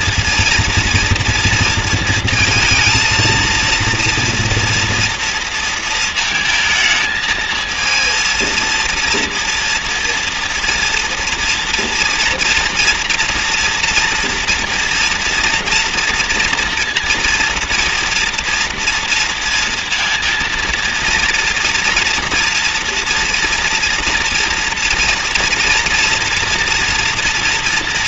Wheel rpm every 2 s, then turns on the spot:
230, 230, 230, 220, 230, 230, 230, 230, 230, 230, 230, 240, 230, 230.
none